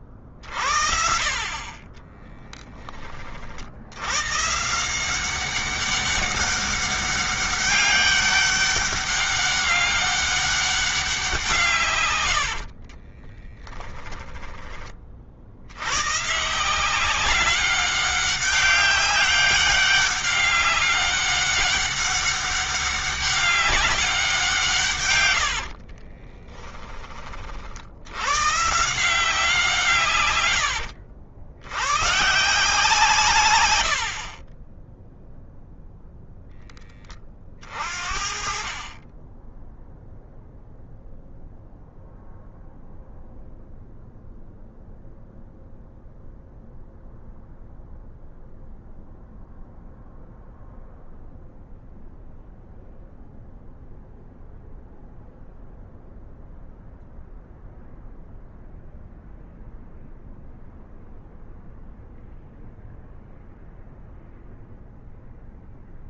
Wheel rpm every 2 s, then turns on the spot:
60, 40, 180, 200, 200, 190, 50, 30, 180, 200, 200, 200, 130, 30, 170, 80, 150, 0, 20, 20, 0, 0, 0, 0, 0, 0, 0, 0, 0, 0, 0, 0, 0.
12-14 24-26 30-32